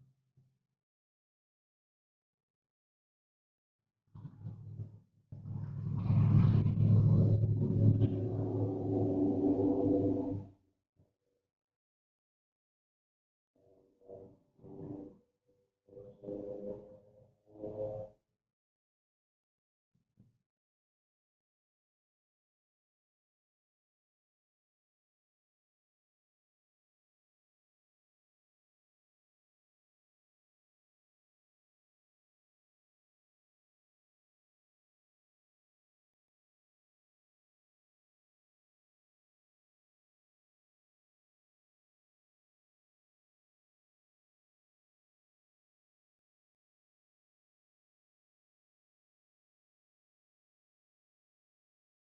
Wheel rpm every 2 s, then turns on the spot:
0, 0, 0, 0, 0, 0, 0, 0, 0, 0, 0, 0, 0, 0, 0, 0, 0, 0, 0, 0, 0, 0, 0, 0, 0, 0.
none